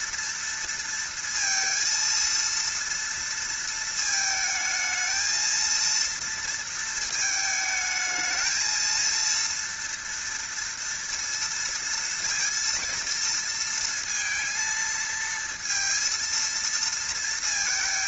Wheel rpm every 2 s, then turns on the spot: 230, 230, 220, 220, 230, 230, 230, 230, 230.
none